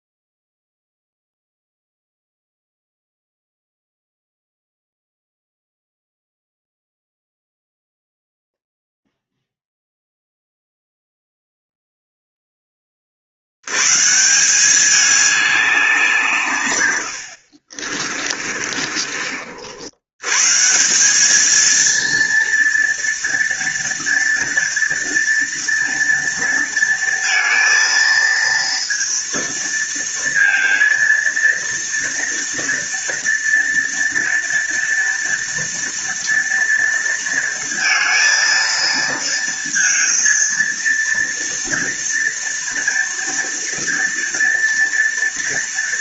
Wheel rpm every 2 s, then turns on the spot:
0, 0, 0, 0, 0, 0, 0, 170, 160, 40, 120, 230, 230, 230, 230, 230, 230, 230, 230, 230, 230, 230, 240.
18-20